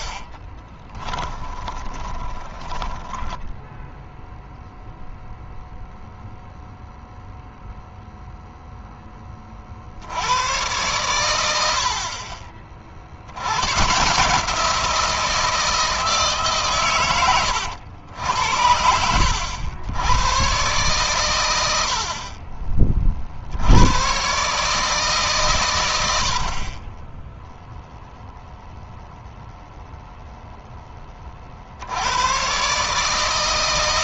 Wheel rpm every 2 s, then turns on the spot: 10, 10, 0, 0, 10, 110, 60, 170, 120, 70, 120, 30, 150, 20, 0, 10, 140.
0-4